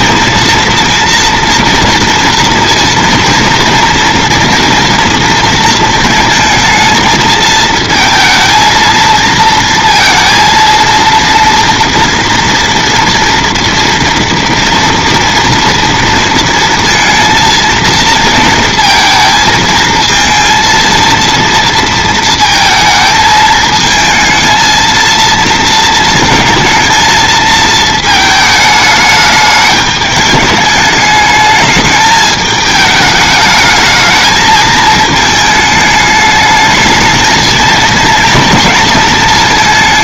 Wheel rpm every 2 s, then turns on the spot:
230, 230, 230, 230, 230, 230, 230, 240, 230, 230, 230, 230, 220, 230, 220, 210, 210, 220, 210, 230.
none